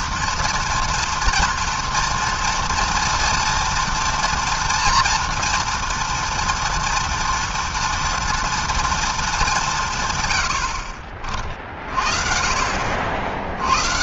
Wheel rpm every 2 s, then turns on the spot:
230, 230, 230, 230, 210, 30, 60.
12-14